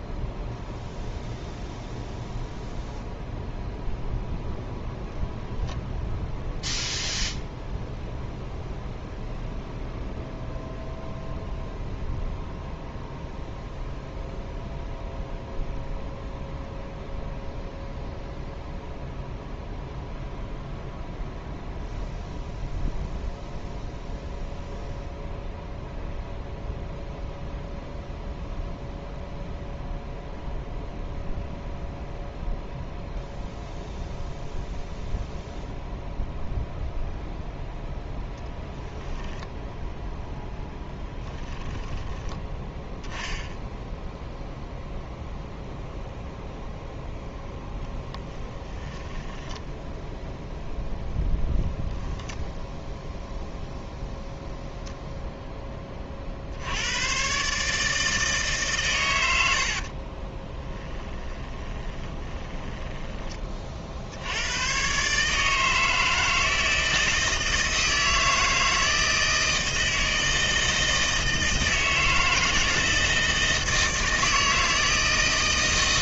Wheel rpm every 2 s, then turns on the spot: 0, 0, 0, 0, 0, 0, 0, 0, 0, 0, 0, 0, 0, 0, 0, 0, 0, 0, 0, 10, 0, 10, 0, 0, 20, 0, 0, 0, 80, 140, 10, 10, 110, 160, 160, 160, 170, 160.
48-50 60-64